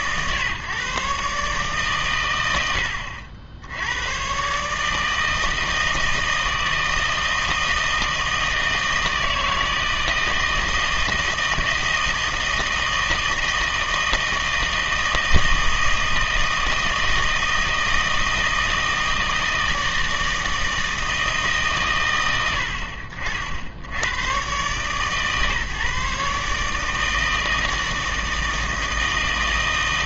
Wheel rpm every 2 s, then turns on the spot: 130, 90, 150, 160, 160, 160, 160, 160, 160, 160, 160, 70, 130, 150, 160.
none